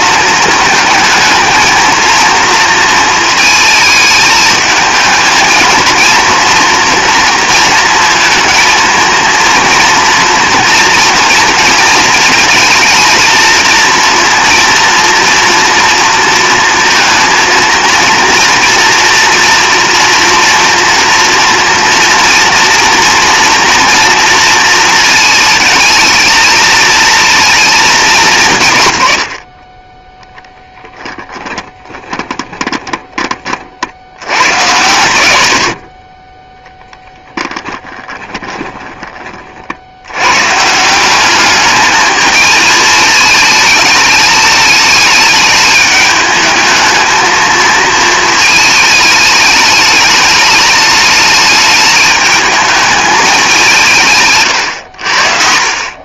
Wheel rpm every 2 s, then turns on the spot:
220, 230, 220, 230, 230, 230, 220, 230, 230, 230, 230, 230, 220, 220, 130, 10, 20, 110, 10, 20, 160, 220, 220, 220, 220, 210, 220, 100.
30-34 36-40